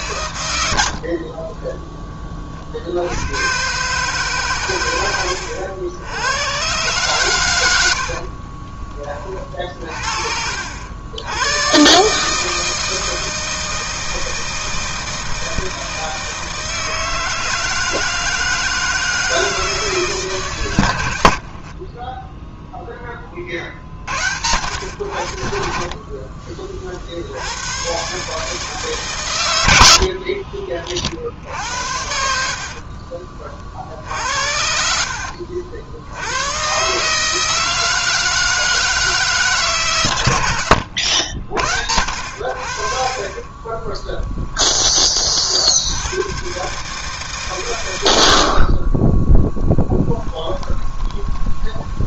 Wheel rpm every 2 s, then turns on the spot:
40, 80, 110, 130, 20, 90, 160, 160, 160, 160, 100, 10, 80, 40, 140, 50, 40, 60, 140, 160, 80, 40, 30, 150, 20, 20.
32-34 50-52